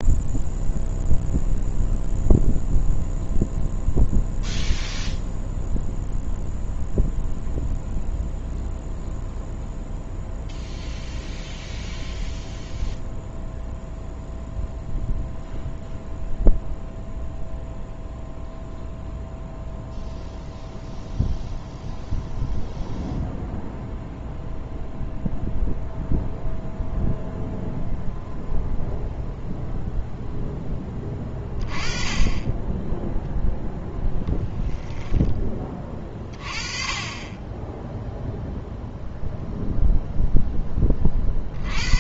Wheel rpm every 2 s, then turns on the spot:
0, 0, 0, 0, 0, 0, 0, 0, 0, 0, 0, 0, 0, 0, 0, 10, 10, 10, 30, 0, 20.
34-36